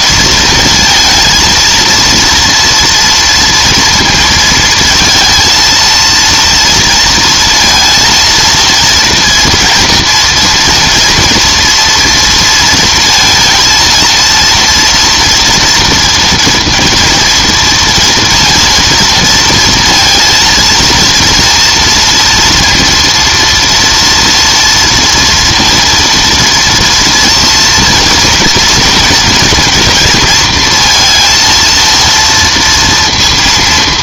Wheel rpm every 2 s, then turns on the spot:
230, 230, 220, 230, 230, 230, 230, 230, 230, 230, 230, 230, 230, 230, 230, 230, 230.
none